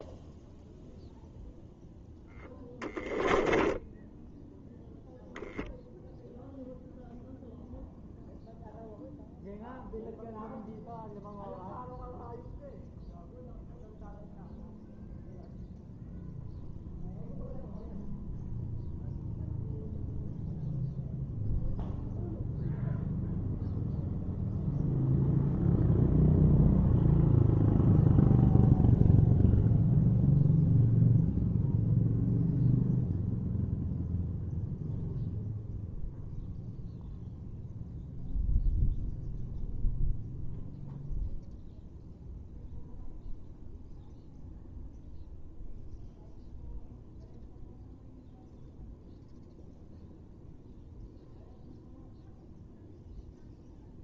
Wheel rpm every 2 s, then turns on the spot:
0, 0, 0, 0, 0, 0, 0, 0, 0, 0, 0, 0, 0, 0, 0, 0, 0, 0, 0, 0, 0, 0, 0, 0, 0, 0, 0.
none